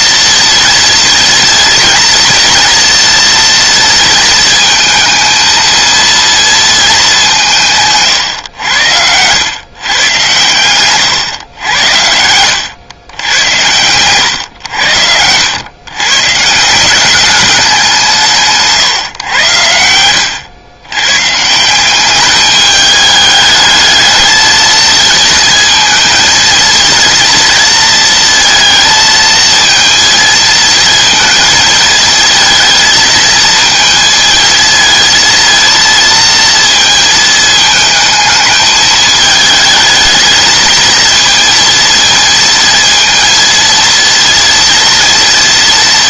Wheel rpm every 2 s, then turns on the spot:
230, 230, 230, 220, 90, 120, 100, 90, 180, 150, 110, 210, 220, 230, 230, 220, 220, 220, 230, 220, 230, 230, 230.
none